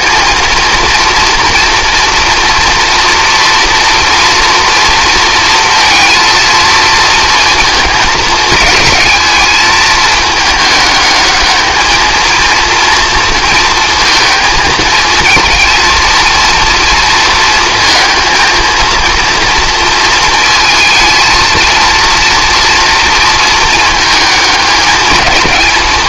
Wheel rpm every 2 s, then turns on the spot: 240, 230, 230, 230, 210, 210, 230, 220, 230, 230, 230, 230, 220.
none